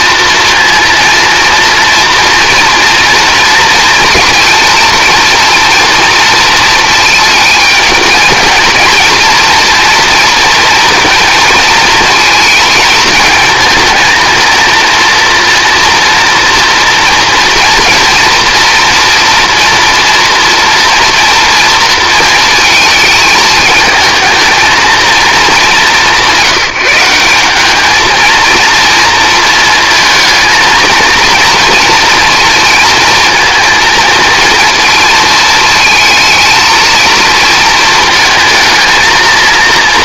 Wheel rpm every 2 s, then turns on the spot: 230, 230, 230, 230, 230, 230, 220, 230, 240, 230, 230, 220, 220, 180, 230, 230, 230, 230, 220, 220.
none